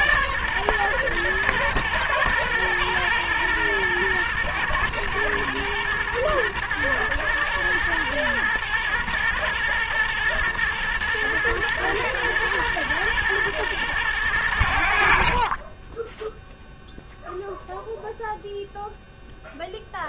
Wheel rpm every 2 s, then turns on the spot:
130, 120, 120, 120, 120, 120, 110, 90, 0, 0.
none